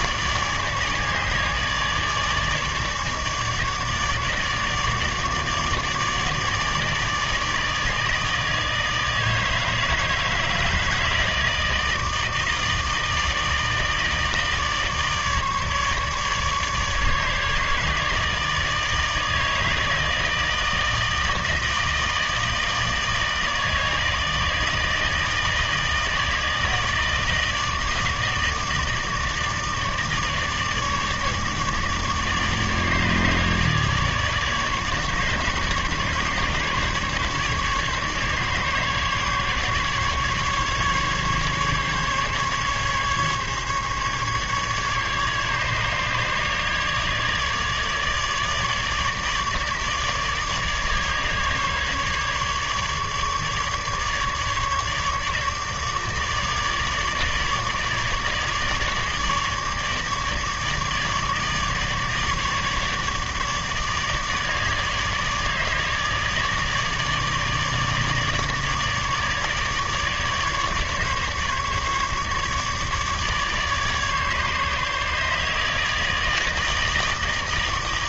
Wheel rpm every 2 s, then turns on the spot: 150, 150, 150, 150, 160, 150, 160, 150, 150, 150, 160, 160, 160, 160, 160, 150, 150, 150, 150, 140, 150, 150, 150, 150, 150, 150, 150, 150, 150, 150, 150, 150, 150, 150, 150, 150, 150, 150, 160.
none